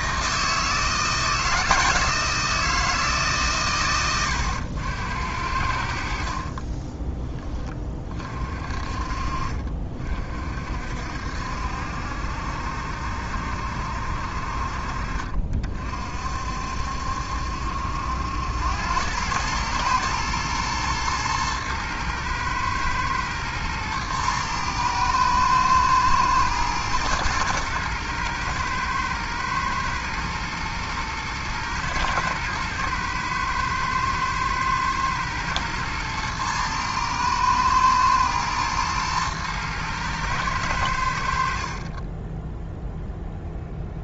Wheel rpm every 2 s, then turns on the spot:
160, 160, 80, 30, 40, 60, 70, 50, 60, 100, 120, 110, 110, 120, 110, 110, 120, 110, 110, 110, 90, 0.
6-8